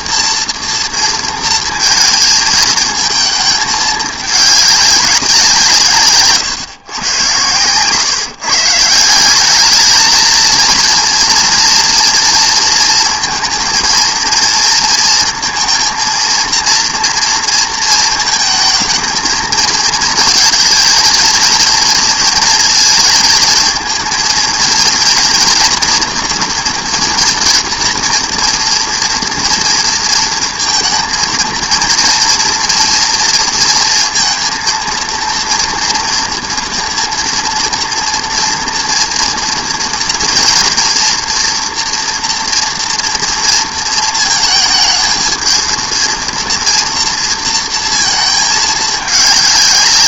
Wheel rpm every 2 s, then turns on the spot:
230, 220, 200, 130, 150, 230, 230, 230, 230, 220, 220, 220, 230, 230, 230, 230, 230, 230, 230, 230, 230, 230, 220, 230, 210.
none